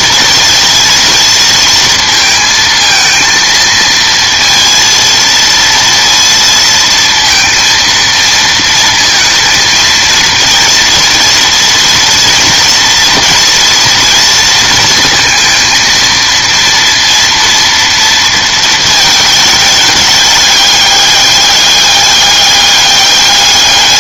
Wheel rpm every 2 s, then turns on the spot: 230, 230, 230, 230, 230, 230, 230, 220, 230, 220, 210, 200.
none